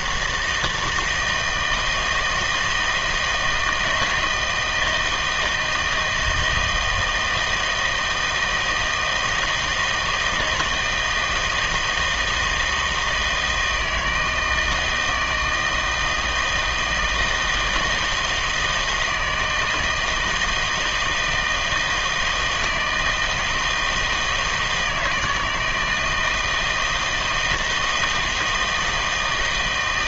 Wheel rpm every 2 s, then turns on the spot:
160, 160, 160, 160, 160, 160, 160, 160, 160, 160, 160, 160, 160, 160, 160.
none